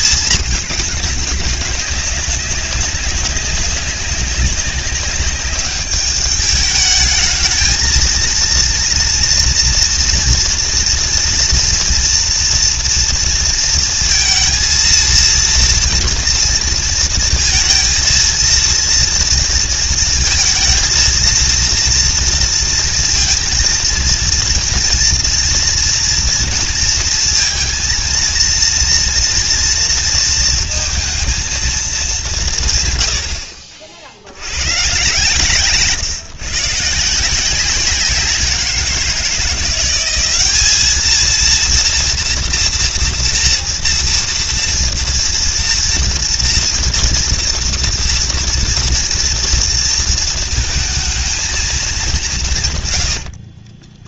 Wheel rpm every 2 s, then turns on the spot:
210, 190, 190, 210, 230, 230, 230, 230, 230, 230, 230, 230, 230, 230, 230, 230, 150, 100, 150, 180, 200, 230, 230, 230, 230, 220, 150.
none